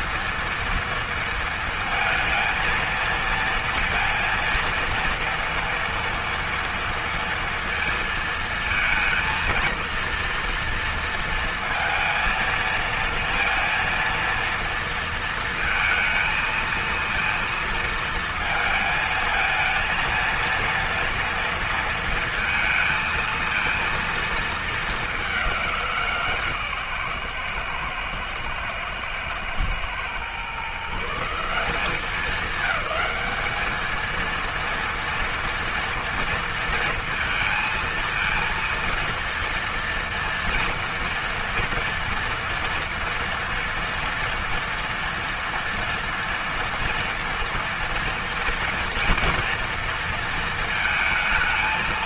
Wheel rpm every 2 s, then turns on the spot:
230, 230, 230, 230, 230, 230, 230, 230, 230, 230, 230, 230, 230, 150, 110, 130, 210, 230, 230, 230, 230, 230, 230, 230, 230, 230.
none